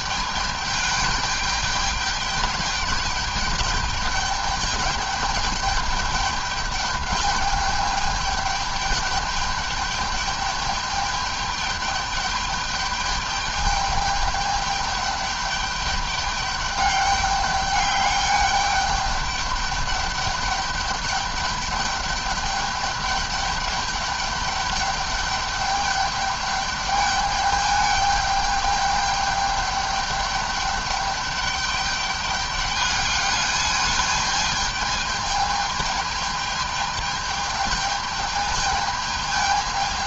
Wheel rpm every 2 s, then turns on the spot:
210, 200, 210, 210, 210, 210, 210, 210, 200, 210, 210, 210, 210, 200, 210, 200, 210, 210, 210, 210.
none